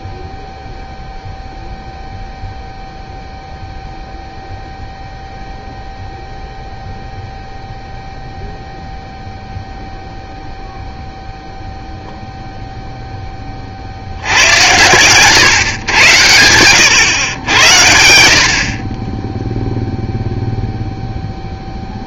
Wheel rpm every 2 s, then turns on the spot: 0, 0, 0, 0, 0, 0, 0, 100, 100, 50, 0.
14-16